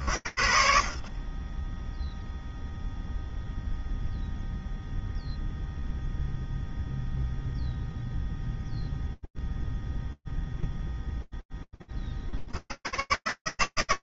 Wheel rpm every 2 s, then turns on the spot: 50, 0, 0, 0, 0, 0, 60.
none